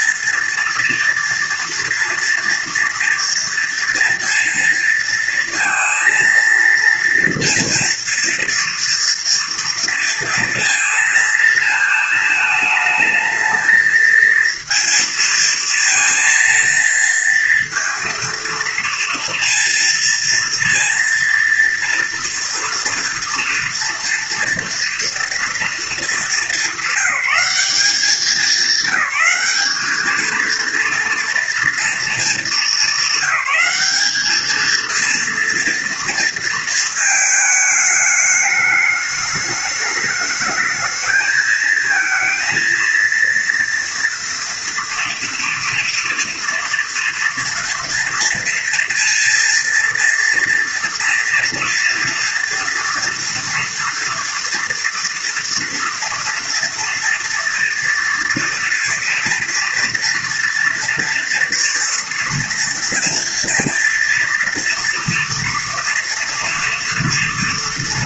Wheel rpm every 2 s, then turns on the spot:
230, 230, 230, 230, 230, 230, 220, 230, 230, 230, 230, 230, 230, 210, 190, 230, 210, 220, 230, 210, 210, 230, 230, 240, 230, 230, 230, 230, 230, 230, 230, 240, 230, 240.
none